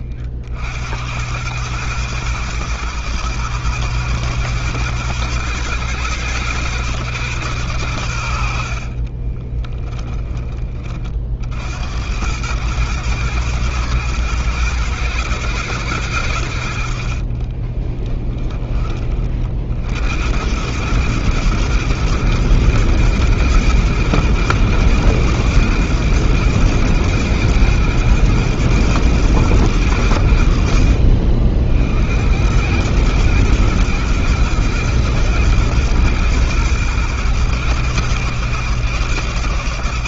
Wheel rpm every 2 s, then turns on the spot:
110, 110, 110, 90, 20, 70, 110, 100, 20, 60, 110, 110, 120, 120, 100, 60, 110, 120, 110, 110.
8-10 16-18